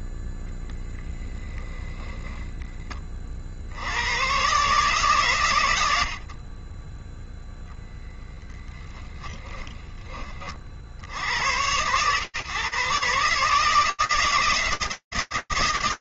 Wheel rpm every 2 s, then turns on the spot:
0, 0, 20, 130, 10, 10, 110, 160.
none